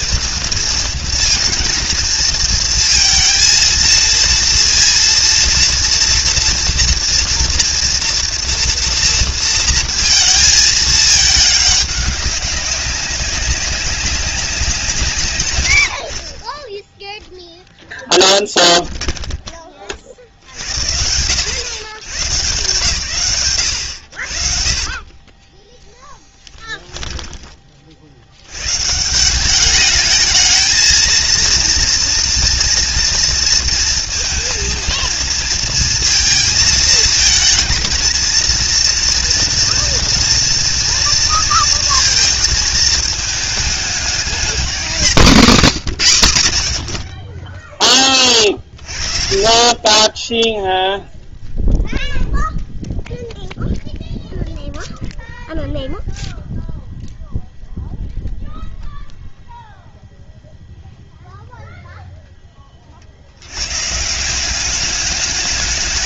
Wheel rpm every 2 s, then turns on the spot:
230, 230, 230, 230, 230, 220, 190, 170, 10, 10, 70, 130, 40, 0, 140, 230, 230, 230, 230, 230, 230, 220, 210, 80, 30, 0, 0, 0, 0, 0, 0, 30, 200.
16-20